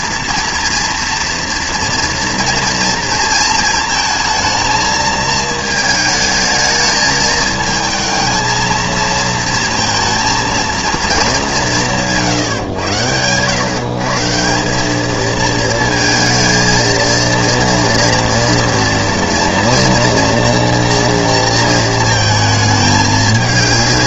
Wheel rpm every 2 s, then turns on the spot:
230, 230, 220, 220, 220, 220, 120, 200, 230, 230, 230, 210.
none